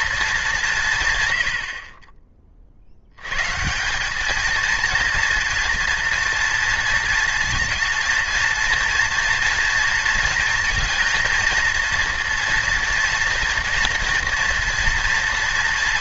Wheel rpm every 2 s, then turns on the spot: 170, 60, 230, 230, 230, 230, 230, 230.
none